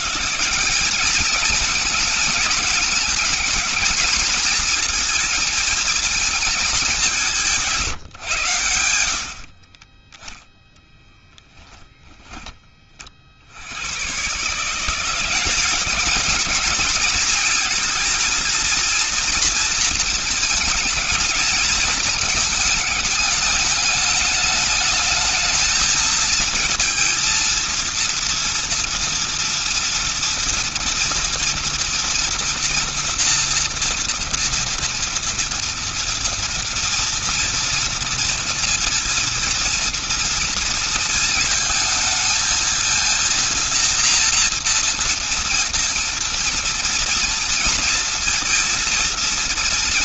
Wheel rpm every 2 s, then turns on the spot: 170, 220, 230, 220, 120, 10, 20, 140, 220, 230, 220, 210, 210, 230, 230, 230, 230, 230, 230, 230, 230, 230, 230, 230, 230.
none